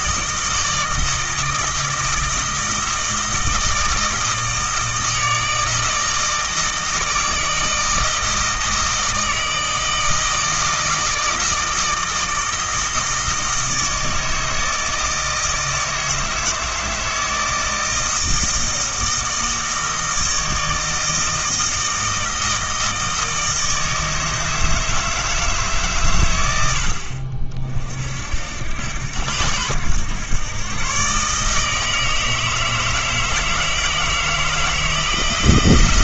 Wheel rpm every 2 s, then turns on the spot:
160, 160, 160, 160, 160, 160, 160, 160, 160, 160, 160, 160, 160, 90, 70, 110, 160, 160.
none